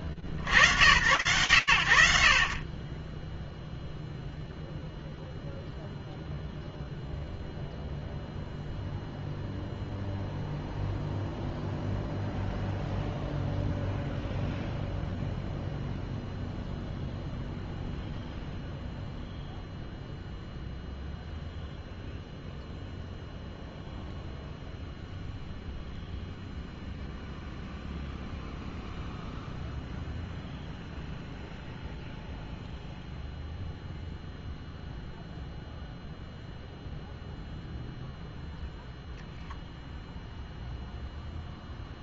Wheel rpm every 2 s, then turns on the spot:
50, 50, 0, 0, 0, 0, 0, 0, 0, 0, 0, 0, 0, 0, 0, 0, 0, 0, 0, 0, 0.
none